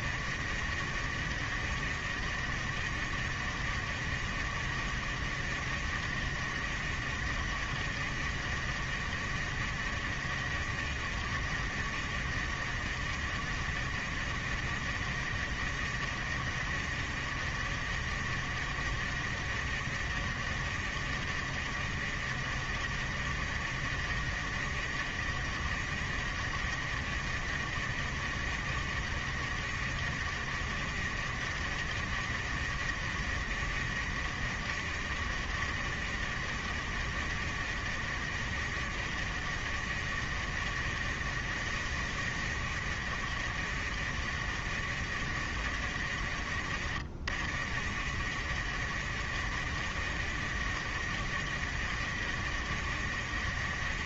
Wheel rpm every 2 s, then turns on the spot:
50, 50, 50, 50, 50, 50, 50, 50, 50, 50, 50, 50, 50, 50, 50, 50, 50, 50, 50, 50, 50, 50, 50, 40, 50, 50, 50.
none